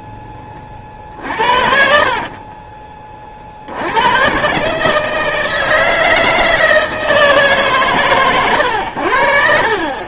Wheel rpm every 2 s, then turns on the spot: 30, 30, 150, 160, 100.
2-4